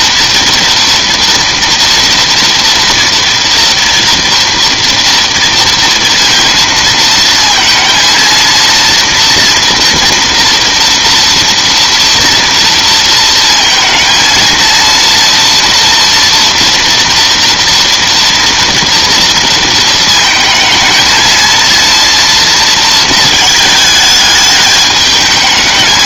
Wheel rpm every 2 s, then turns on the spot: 230, 230, 230, 230, 230, 230, 230, 230, 230, 230, 230, 220, 220.
none